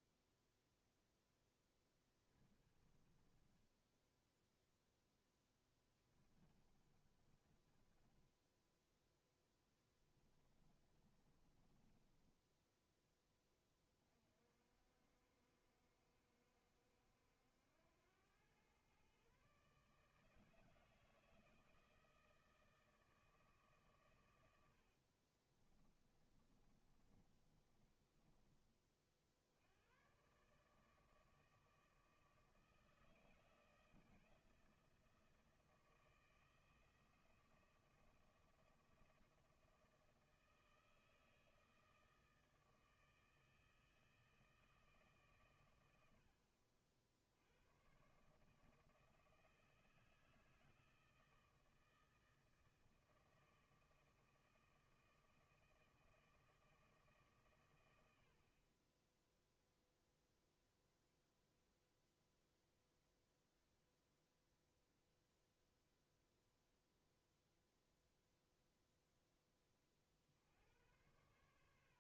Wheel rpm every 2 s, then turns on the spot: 0, 30, 0, 30, 10, 30, 10, 60, 70, 120, 160, 160, 80, 30, 30, 150, 160, 170, 170, 170, 160, 160, 160, 80, 160, 160, 160, 160, 160, 30, 0, 0, 0, 0, 0, 90.
2-4 6-8 10-12 26-28